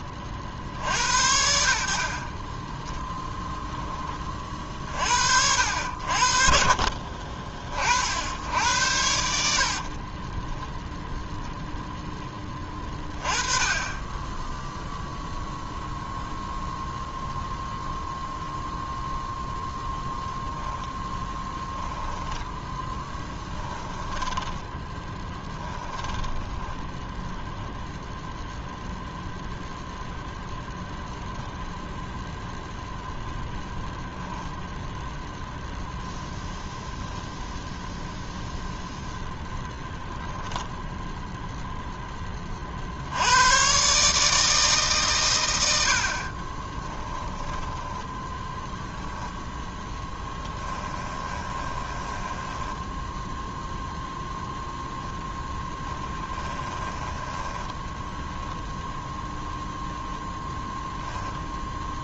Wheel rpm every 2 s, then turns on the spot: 60, 10, 40, 50, 80, 10, 20, 0, 0, 0, 10, 10, 10, 0, 0, 0, 0, 0, 0, 0, 0, 80, 140, 20, 10, 10, 10, 0, 20, 0, 0.
6-8 10-12 20-26 46-48 50-54 56-58